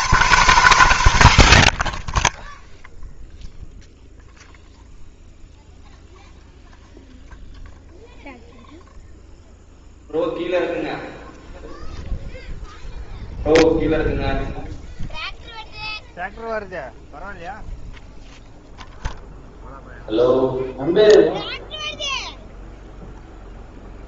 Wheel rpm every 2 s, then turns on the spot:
200, 0, 0, 0, 0, 0, 0, 0, 0, 0, 0, 0.
none